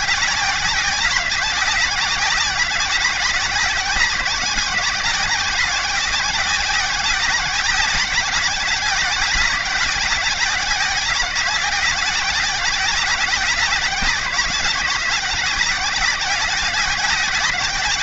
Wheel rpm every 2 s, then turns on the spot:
190, 190, 180, 190, 180, 190, 180, 180, 190.
none